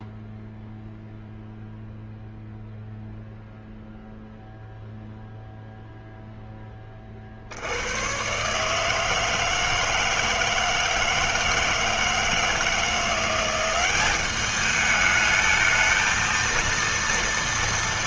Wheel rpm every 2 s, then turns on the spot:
0, 0, 0, 40, 160, 160, 170, 210, 230.
none